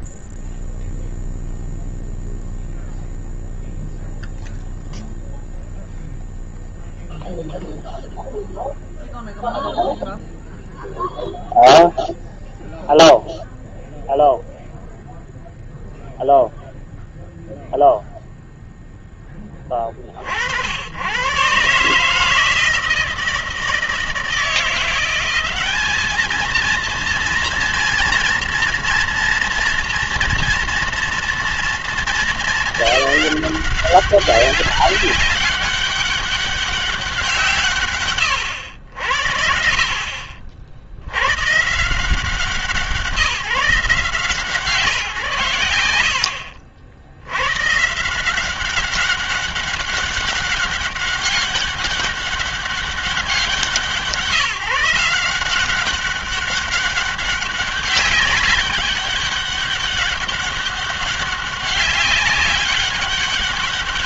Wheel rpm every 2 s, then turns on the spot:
0, 0, 0, 0, 0, 0, 0, 0, 0, 0, 90, 160, 170, 230, 230, 230, 200, 190, 190, 80, 80, 170, 150, 70, 190, 200, 190, 160, 200, 200, 200, 200.
none